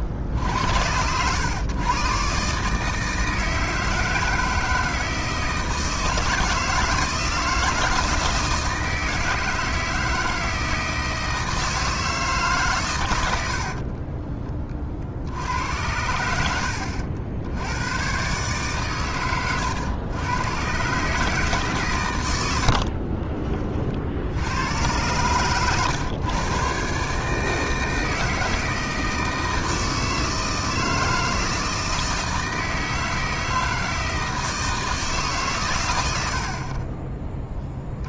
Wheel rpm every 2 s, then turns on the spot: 90, 150, 160, 160, 160, 160, 120, 30, 80, 130, 140, 60, 100, 130, 160, 160, 160, 160, 30.
22-24